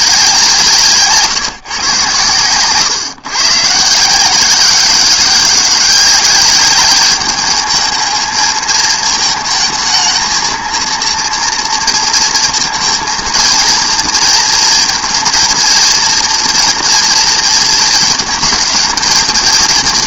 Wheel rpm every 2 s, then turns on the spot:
170, 130, 190, 200, 220, 230, 230, 230, 230, 230.
none